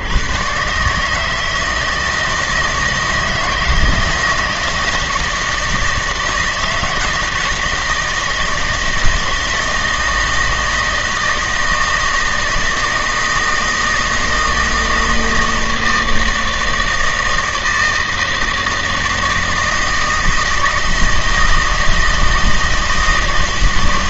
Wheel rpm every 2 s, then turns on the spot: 140, 160, 160, 160, 160, 160, 160, 160, 160, 160, 160, 160.
none